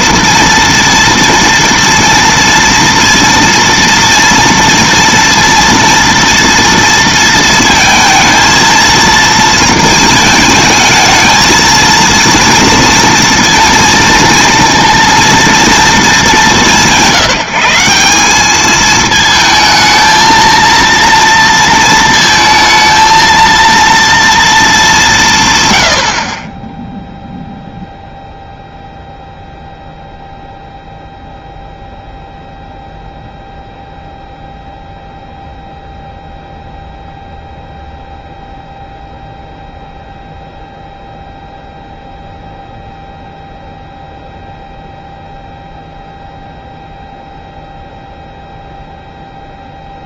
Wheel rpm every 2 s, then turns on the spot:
230, 230, 230, 240, 230, 220, 230, 230, 190, 180, 220, 230, 230, 70, 0, 0, 0, 0, 0, 0, 0, 0, 0, 0, 0.
none